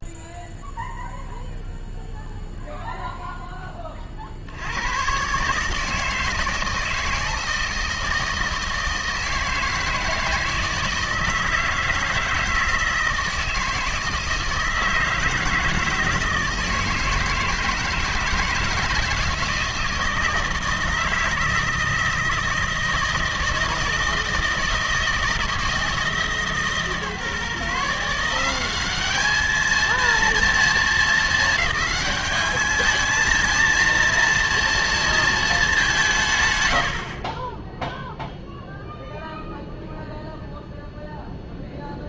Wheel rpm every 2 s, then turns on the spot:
0, 0, 90, 160, 160, 160, 160, 160, 160, 160, 160, 160, 160, 150, 190, 230, 210, 230, 100, 0, 0.
none